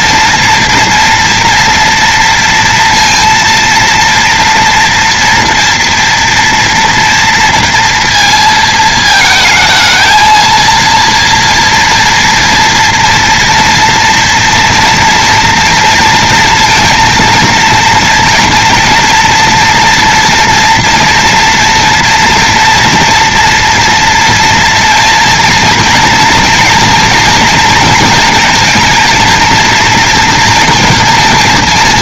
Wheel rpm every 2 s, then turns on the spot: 230, 230, 230, 240, 230, 230, 230, 230, 230, 230, 230, 230, 230, 230, 230, 230.
none